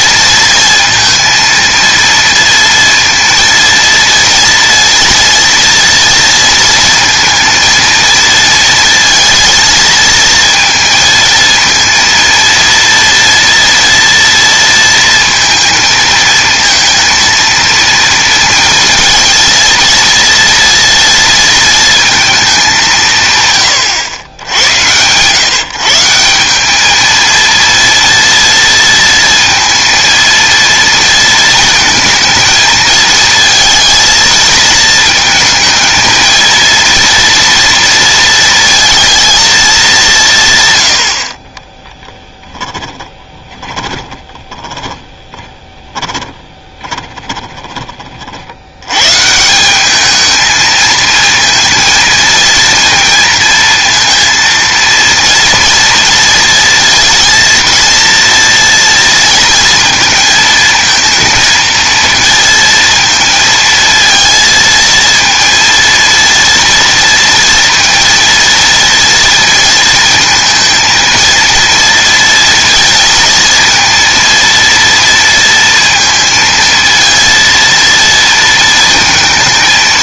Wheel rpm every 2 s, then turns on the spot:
230, 230, 230, 230, 230, 220, 230, 230, 230, 230, 230, 190, 100, 210, 230, 230, 220, 220, 230, 230, 90, 10, 20, 20, 110, 230, 230, 230, 230, 230, 230, 230, 230, 230, 230, 230, 230, 230, 230, 230.
42-48